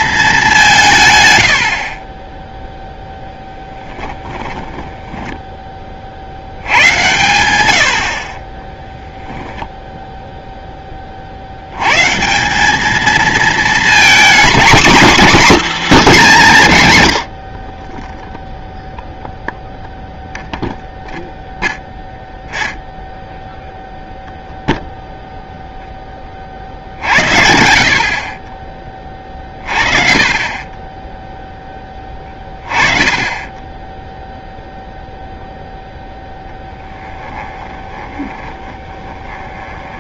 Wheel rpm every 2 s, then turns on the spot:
180, 0, 20, 80, 20, 10, 170, 250, 210, 0, 0, 0, 0, 40, 30, 20, 20, 0, 10, 20.
4-6 8-10 38-40